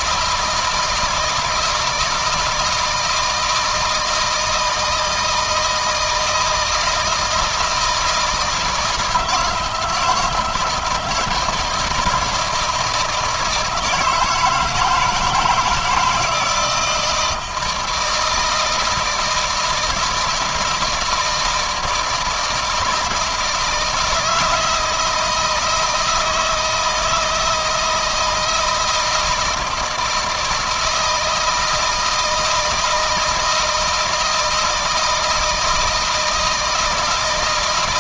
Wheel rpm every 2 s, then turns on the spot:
160, 160, 160, 160, 160, 170, 160, 160, 160, 160, 160, 160, 160, 160, 160, 160, 160, 160, 160.
none